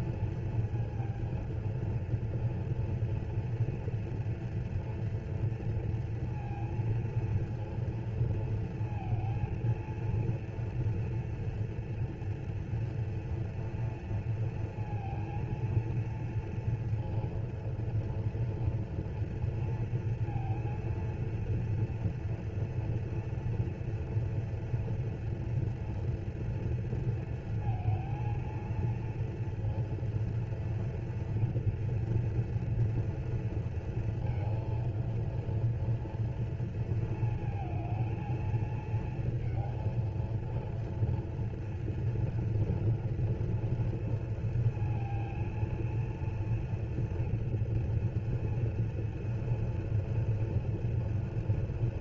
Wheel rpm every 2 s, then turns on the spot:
230, 230, 230, 230, 230, 230, 240, 230, 230, 230, 230, 230, 230, 240, 230, 230, 230, 230, 230, 230, 230, 230, 240, 230, 230, 230.
none